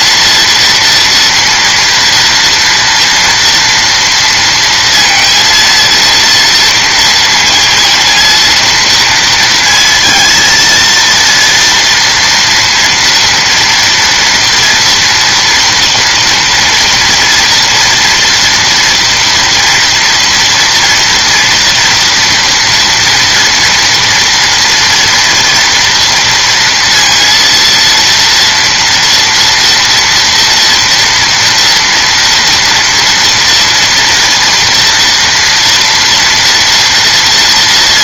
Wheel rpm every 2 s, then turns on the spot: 230, 230, 230, 230, 230, 230, 240, 230, 230, 230, 230, 230, 230, 230, 230, 230, 230, 230, 240.
none